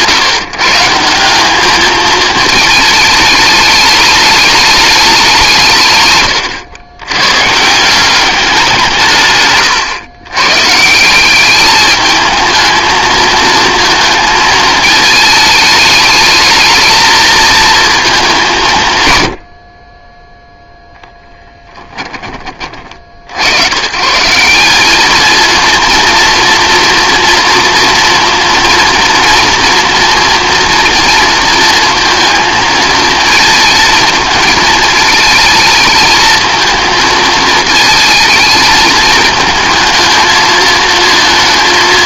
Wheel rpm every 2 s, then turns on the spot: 150, 220, 210, 110, 180, 130, 220, 220, 220, 160, 0, 40, 200, 230, 230, 230, 220, 220, 220, 220, 220.
none